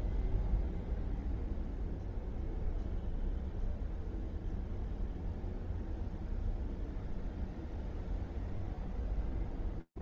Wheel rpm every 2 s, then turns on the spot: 0, 0, 0, 0, 0.
none